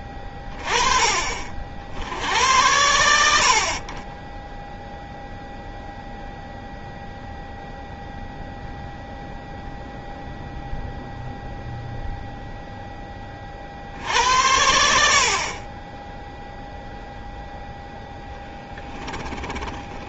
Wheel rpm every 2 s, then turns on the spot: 40, 80, 0, 0, 0, 0, 0, 70, 0, 20.
18-20